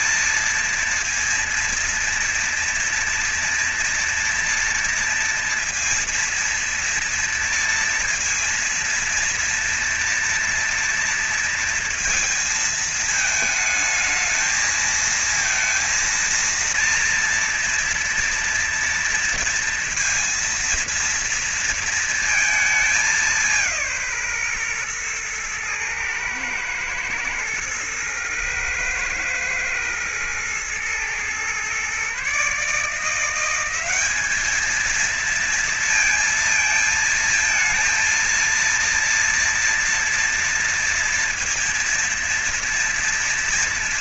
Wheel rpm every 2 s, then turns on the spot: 230, 230, 230, 230, 230, 230, 230, 220, 230, 230, 230, 230, 150, 120, 120, 110, 140, 200, 230, 230, 230, 230.
none